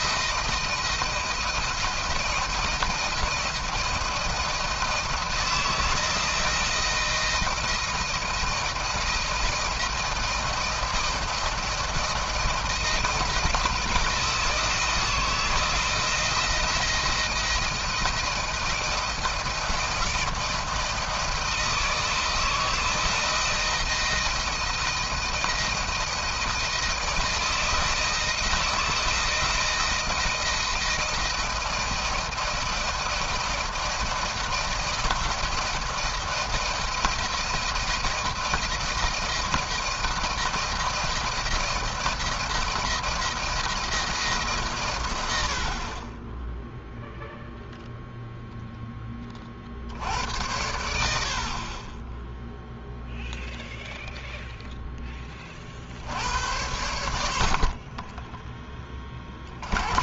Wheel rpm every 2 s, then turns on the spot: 170, 170, 160, 170, 160, 170, 170, 160, 170, 160, 160, 160, 160, 160, 170, 170, 170, 160, 160, 160, 170, 160, 120, 0, 10, 90, 0, 10, 90, 20.
none